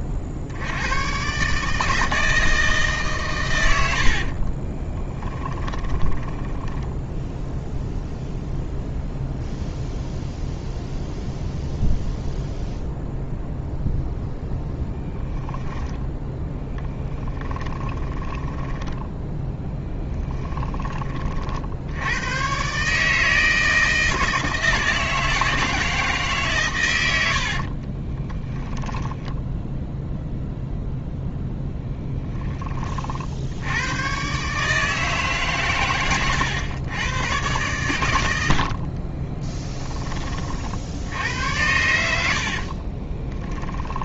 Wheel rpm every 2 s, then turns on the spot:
50, 160, 40, 20, 0, 0, 0, 0, 10, 10, 10, 130, 160, 130, 0, 0, 30, 150, 100, 60, 70, 30.
4-8 16-20 38-40 42-44